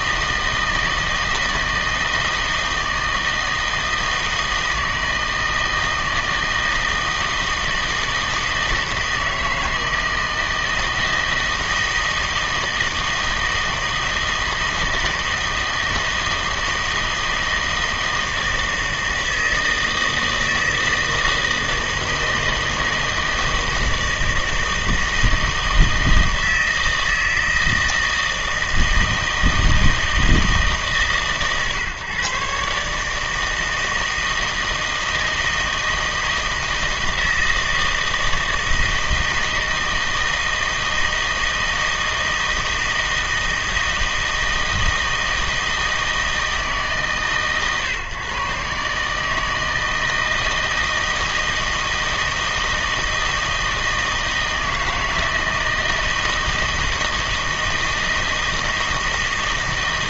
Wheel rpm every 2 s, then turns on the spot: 160, 160, 160, 160, 160, 160, 160, 160, 160, 160, 160, 160, 160, 160, 160, 150, 140, 160, 160, 160, 160, 160, 160, 160, 140, 160, 160, 160, 160, 160.
none